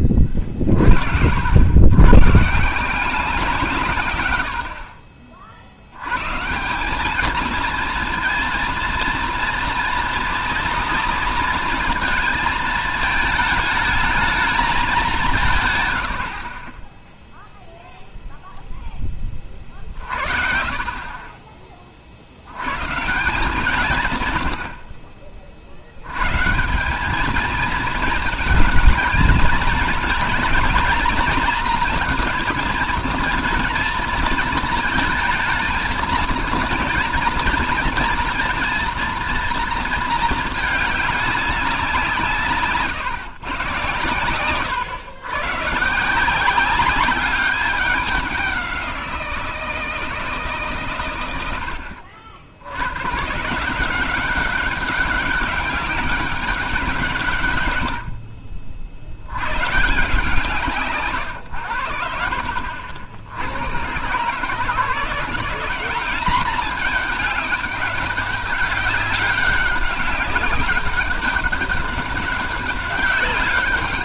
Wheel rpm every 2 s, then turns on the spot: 30, 150, 70, 160, 230, 230, 220, 210, 40, 0, 30, 110, 80, 150, 220, 230, 220, 220, 230, 230, 220, 160, 110, 180, 190, 150, 90, 190, 190, 50, 140, 60, 150, 210, 200, 200, 200.
none